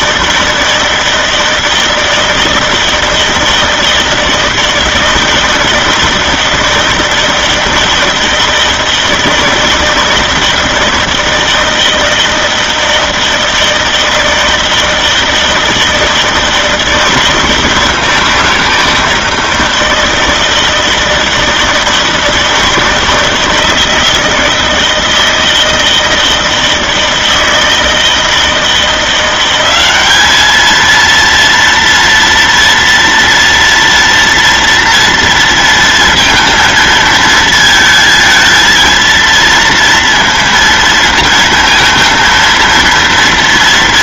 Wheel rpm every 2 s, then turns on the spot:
160, 160, 160, 160, 160, 160, 160, 160, 160, 160, 160, 160, 160, 160, 170, 220, 240, 230, 230, 220, 230, 230.
none